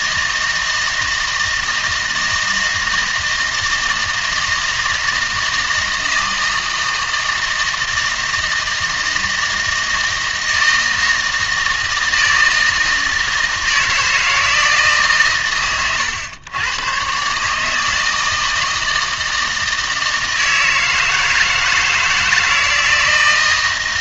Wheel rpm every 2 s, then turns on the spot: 160, 160, 160, 160, 160, 160, 160, 160, 110, 160, 160, 160.
none